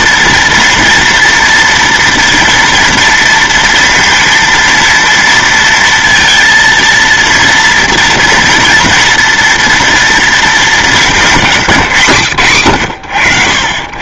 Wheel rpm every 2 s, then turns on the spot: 240, 230, 230, 230, 230, 210, 100.
none